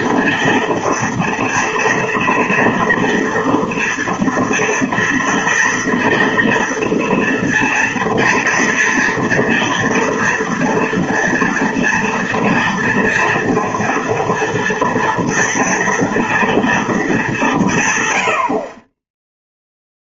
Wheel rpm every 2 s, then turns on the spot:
240, 230, 230, 230, 230, 230, 230, 230, 220, 30.
none